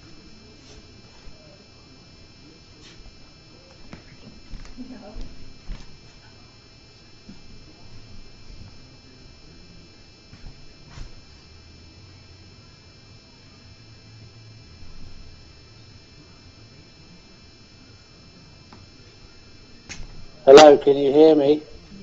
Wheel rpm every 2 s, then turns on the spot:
0, 0, 0, 0, 0, 0, 0, 0, 0, 0, 0.
none